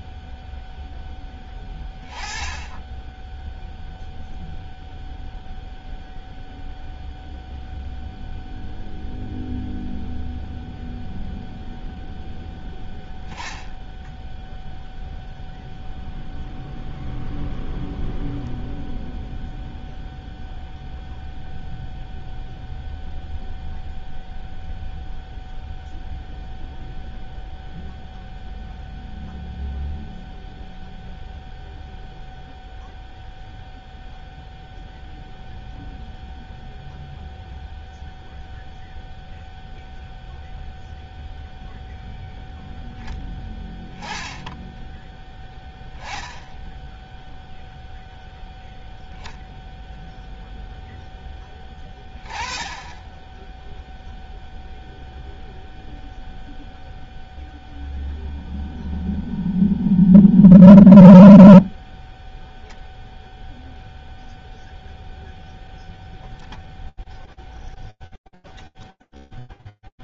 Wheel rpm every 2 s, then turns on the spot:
0, 10, 0, 0, 0, 0, 0, 0, 0, 0, 0, 0, 0, 0, 0, 0, 0, 0, 0, 0, 0, 10, 10, 0, 0, 0, 20, 0, 0, 0, 0, 0, 0, 0, 0.
none